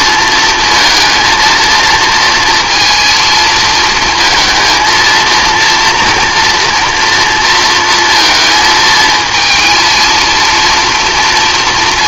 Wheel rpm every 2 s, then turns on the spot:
230, 220, 230, 230, 220, 230.
none